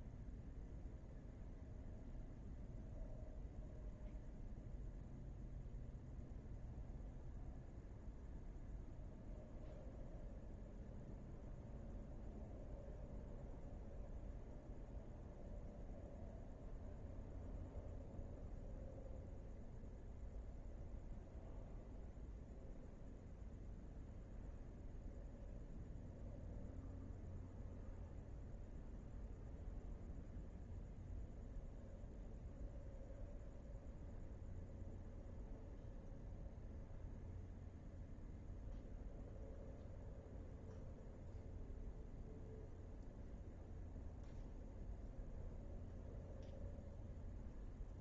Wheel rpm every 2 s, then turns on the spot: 0, 0, 0, 0, 0, 0, 0, 0, 0, 0, 0, 0, 0, 0, 0, 0, 0, 0, 0, 0, 0, 0, 0, 0.
none